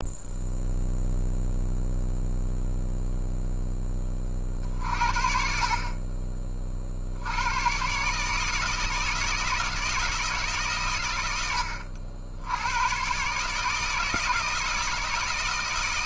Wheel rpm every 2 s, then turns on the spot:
0, 0, 50, 60, 160, 130, 110, 160.
none